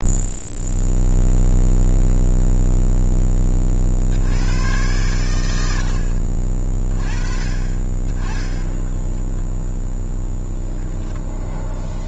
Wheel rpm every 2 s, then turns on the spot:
0, 0, 100, 30, 0, 0.
none